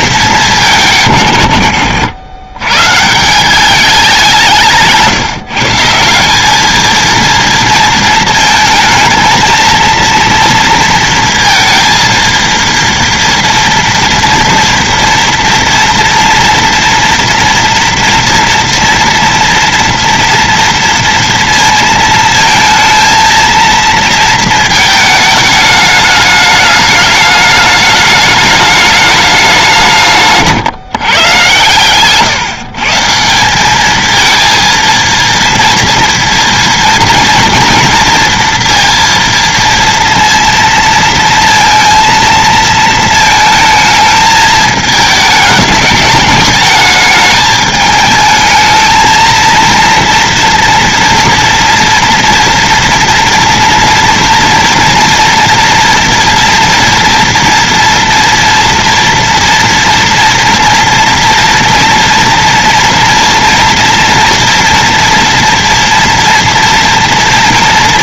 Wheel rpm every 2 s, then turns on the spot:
180, 120, 160, 220, 220, 230, 230, 240, 230, 230, 230, 220, 220, 210, 210, 150, 140, 230, 230, 230, 230, 230, 220, 220, 220, 230, 230, 230, 230, 230, 230, 240, 230, 230.
none